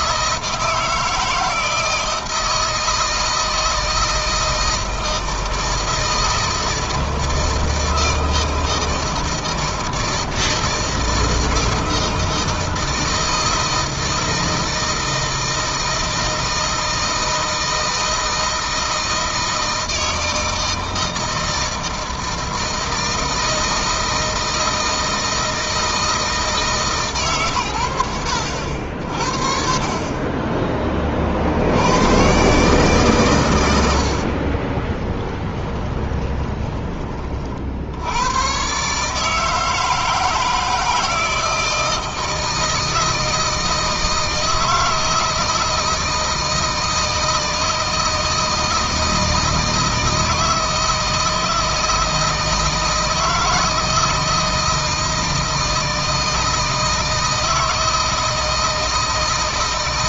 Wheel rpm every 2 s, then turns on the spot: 160, 160, 160, 160, 160, 160, 160, 160, 160, 160, 160, 160, 160, 160, 70, 20, 130, 50, 20, 120, 160, 160, 160, 160, 160, 160, 160, 160, 160, 160.
34-38